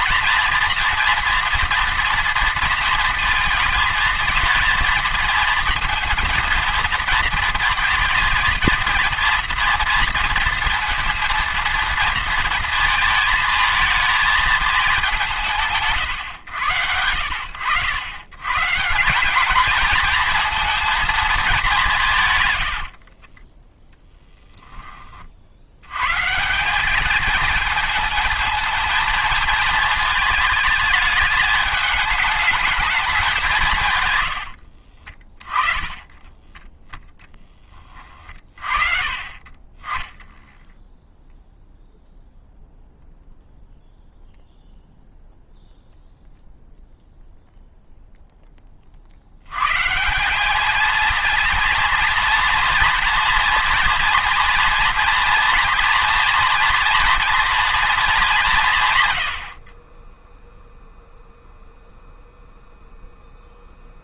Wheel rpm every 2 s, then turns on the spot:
230, 230, 220, 220, 220, 230, 230, 220, 120, 140, 230, 120, 10, 180, 220, 220, 210, 80, 20, 30, 0, 0, 0, 0, 10, 200, 230, 230, 240, 190, 0, 0.
34-38